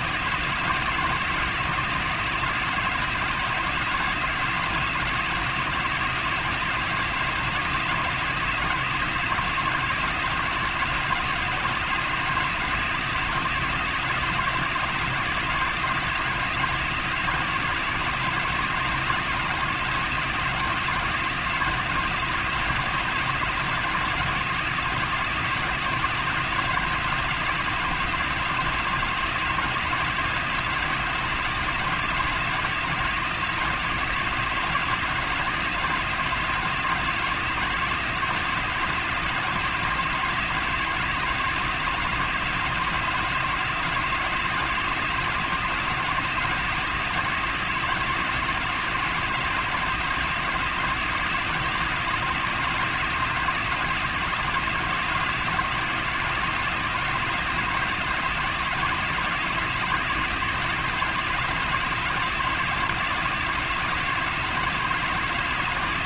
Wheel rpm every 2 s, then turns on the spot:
170, 170, 170, 170, 170, 170, 170, 170, 170, 170, 170, 170, 170, 170, 170, 170, 170, 170, 170, 170, 170, 170, 170, 170, 160, 170, 170, 170, 170, 160, 170, 170, 170.
none